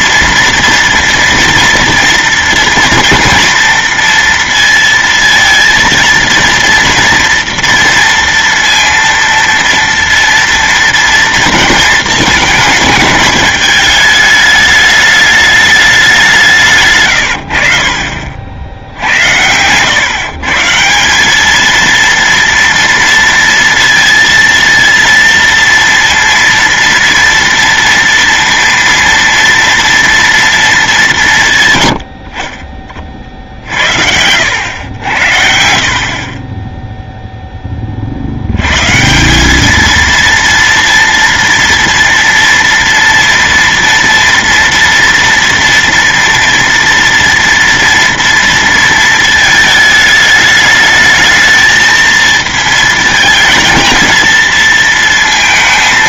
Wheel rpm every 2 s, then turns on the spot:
230, 230, 230, 230, 230, 230, 220, 210, 160, 60, 160, 230, 230, 230, 230, 220, 30, 90, 20, 110, 230, 230, 240, 230, 230, 210, 220, 220.
none